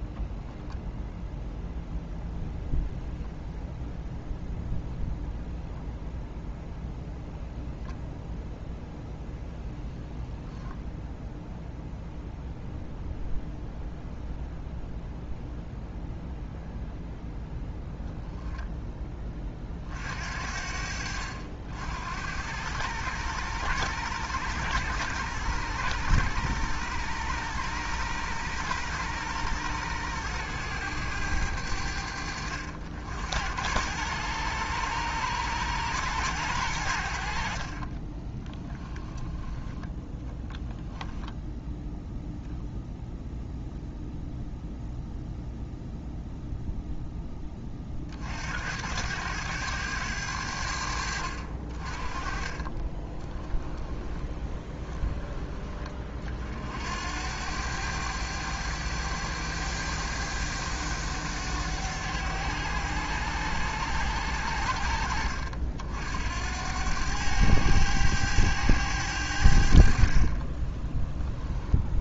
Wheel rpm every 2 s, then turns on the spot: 0, 0, 0, 0, 0, 0, 0, 0, 0, 20, 60, 100, 100, 100, 100, 100, 70, 100, 70, 20, 10, 0, 0, 0, 90, 70, 30, 20, 80, 100, 100, 100, 70, 100, 90, 10.
38-40 52-54 70-72